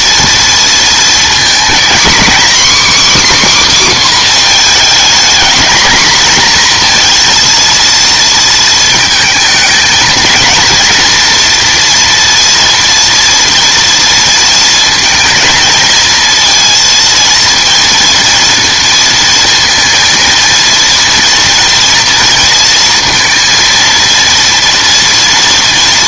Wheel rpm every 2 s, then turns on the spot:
230, 280, 240, 240, 230, 240, 230, 220, 230, 230, 230, 230, 230.
none